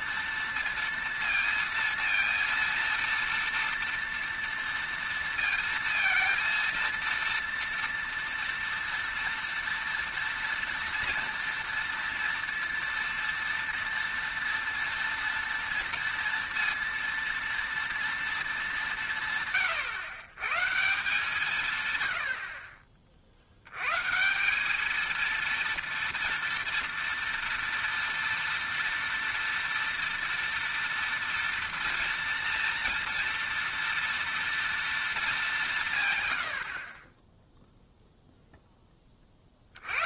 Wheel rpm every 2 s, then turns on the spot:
230, 230, 230, 230, 230, 230, 230, 230, 230, 210, 140, 40, 190, 230, 230, 230, 230, 230, 90, 0.
none